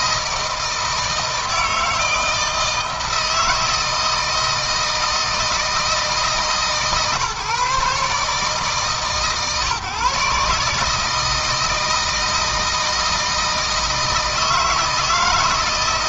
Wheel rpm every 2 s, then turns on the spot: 160, 160, 160, 150, 150, 150, 160, 160.
none